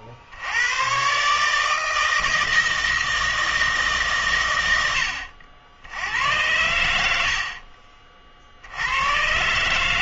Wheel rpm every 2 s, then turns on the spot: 90, 160, 110, 100, 70.
none